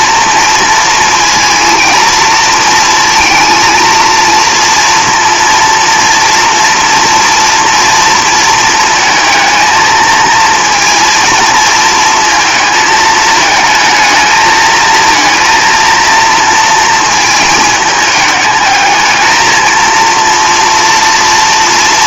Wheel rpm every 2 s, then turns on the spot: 230, 230, 230, 230, 230, 230, 220, 220, 230, 210, 230.
none